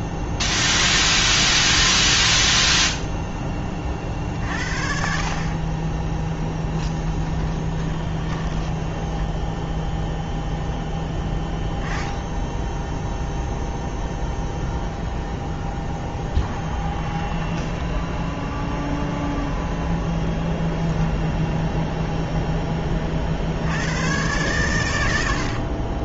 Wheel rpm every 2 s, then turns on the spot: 0, 0, 50, 10, 20, 0, 0, 0, 10, 0, 0, 0, 120.
8-10 16-18